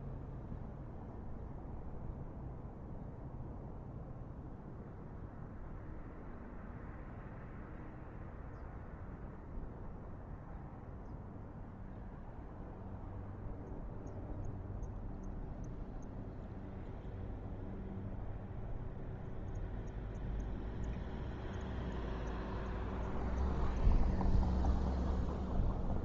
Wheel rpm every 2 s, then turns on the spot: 0, 0, 0, 0, 0, 0, 0, 0, 0, 0, 0, 0, 0.
none